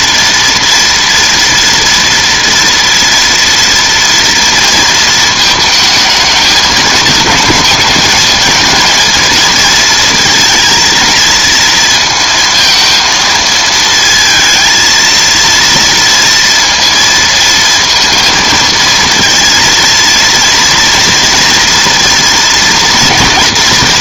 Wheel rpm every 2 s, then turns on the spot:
230, 230, 230, 220, 230, 230, 220, 220, 230, 230, 230, 230.
none